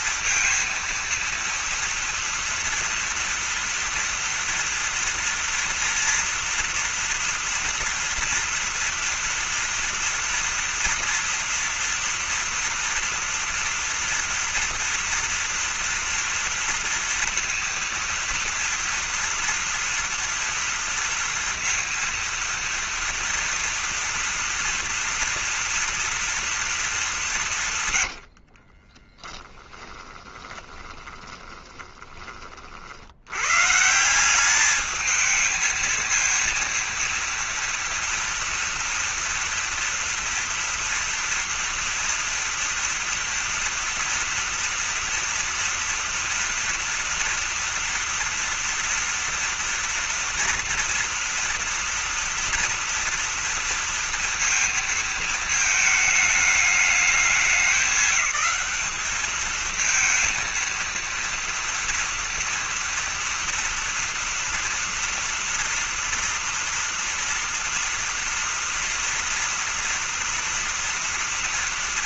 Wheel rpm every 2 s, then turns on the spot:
230, 240, 240, 230, 230, 230, 230, 230, 230, 230, 230, 230, 240, 220, 50, 20, 40, 200, 230, 240, 230, 230, 230, 230, 230, 230, 230, 230, 210, 190, 230, 230, 230, 230, 230, 240.
28-32